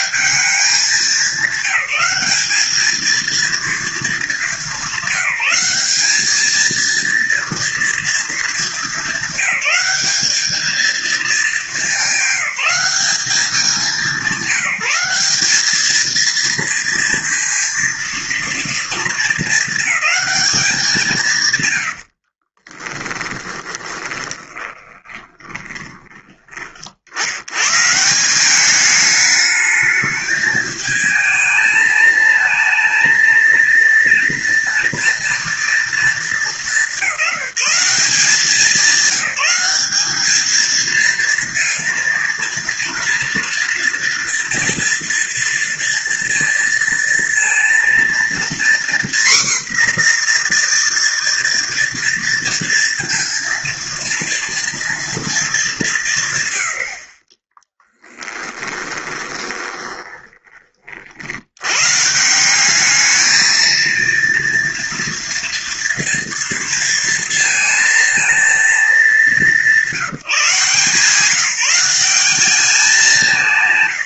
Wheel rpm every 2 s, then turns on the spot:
200, 200, 210, 220, 220, 210, 190, 190, 230, 230, 210, 50, 20, 20, 190, 220, 220, 230, 210, 190, 220, 240, 230, 230, 240, 240, 230, 240, 130, 10, 30, 180, 230, 230, 230, 160, 200.
22-26 58-60